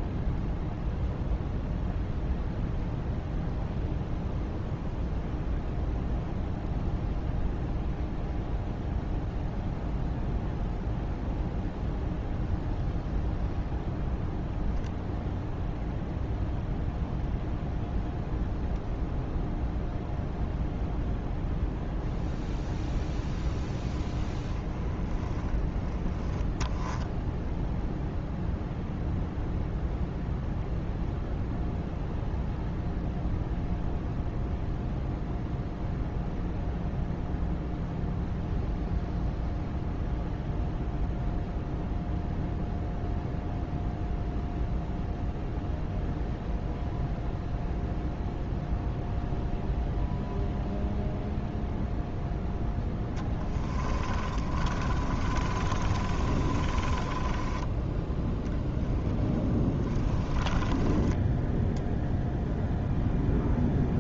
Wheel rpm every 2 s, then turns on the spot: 0, 0, 0, 0, 0, 0, 0, 0, 0, 0, 0, 0, 10, 0, 0, 0, 0, 0, 0, 0, 0, 0, 0, 0, 0, 0, 10, 30, 20, 0, 20, 0.
52-58 60-62